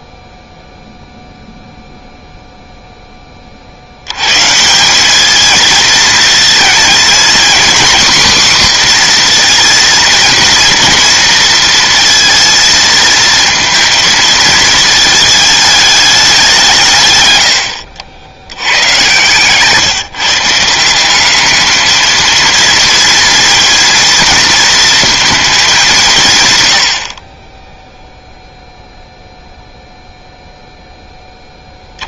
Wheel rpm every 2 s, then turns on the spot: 0, 0, 190, 230, 250, 240, 230, 220, 140, 120, 180, 230, 230, 90, 0, 0.
none